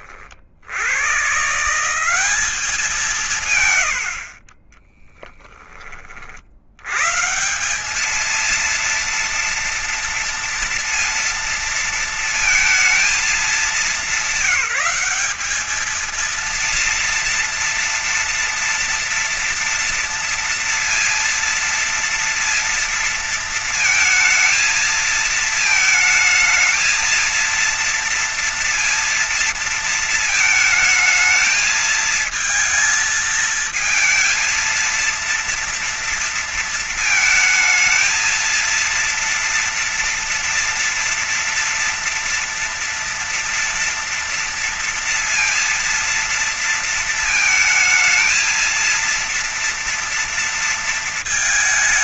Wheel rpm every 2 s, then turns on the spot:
60, 190, 50, 60, 210, 230, 230, 190, 230, 230, 230, 230, 220, 220, 230, 220, 220, 230, 230, 220, 230, 230, 230, 230, 230, 230.
none